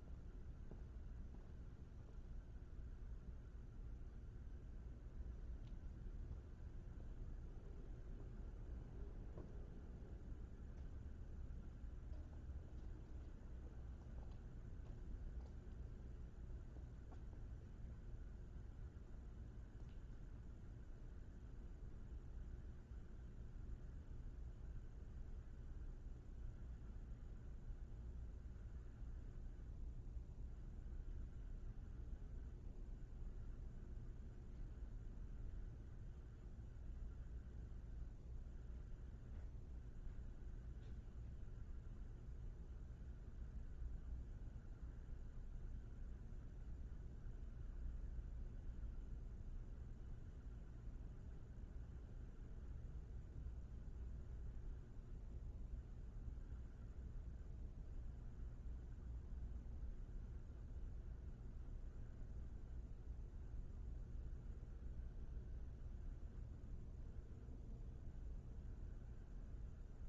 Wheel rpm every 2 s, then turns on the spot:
0, 0, 0, 0, 0, 0, 0, 0, 0, 0, 0, 0, 0, 0, 0, 0, 0, 0, 0, 0, 0, 0, 0, 0, 0, 0, 0, 0, 0, 0, 0, 0, 0, 0, 0.
none